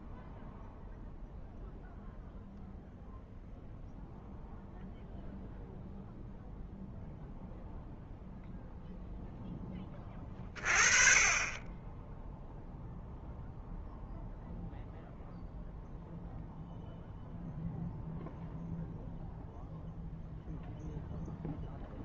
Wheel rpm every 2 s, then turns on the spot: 0, 0, 0, 0, 0, 30, 0, 0, 0, 0, 0.
none